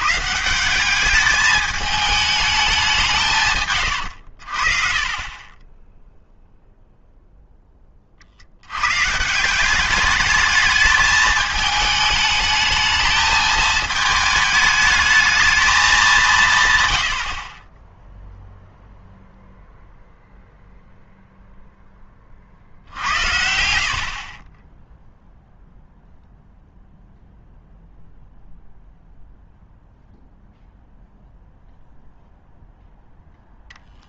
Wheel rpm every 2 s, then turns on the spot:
180, 200, 50, 0, 90, 220, 210, 220, 140, 0, 0, 60, 20, 0, 0, 0, 0.
none